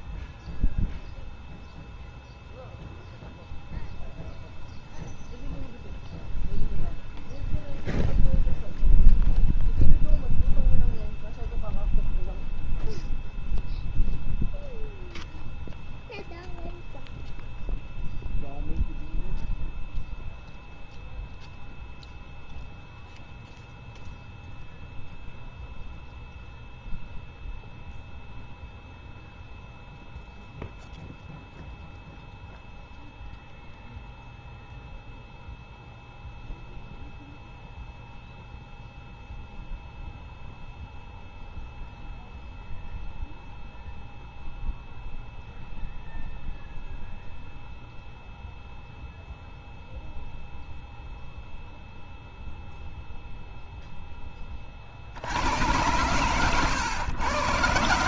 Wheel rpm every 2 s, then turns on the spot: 0, 0, 0, 0, 0, 0, 0, 0, 0, 0, 0, 0, 0, 0, 0, 0, 0, 0, 0, 0, 0, 0, 0, 0, 0, 0, 0, 20, 120.
none